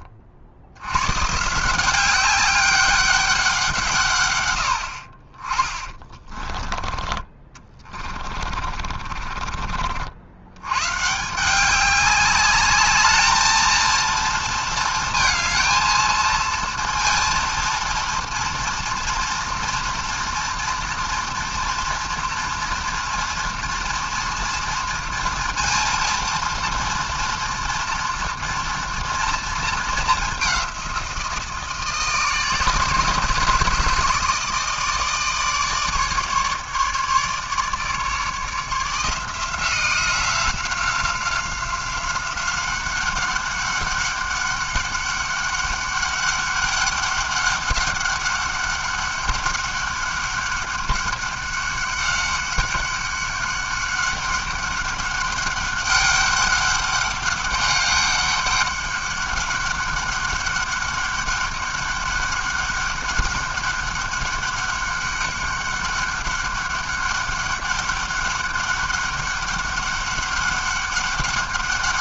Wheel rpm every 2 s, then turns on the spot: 80, 200, 90, 20, 30, 100, 210, 220, 230, 230, 230, 230, 230, 230, 230, 200, 160, 160, 150, 160, 180, 190, 200, 200, 200, 200, 190, 200, 200, 200, 200, 200, 200, 200, 200, 200.
6-10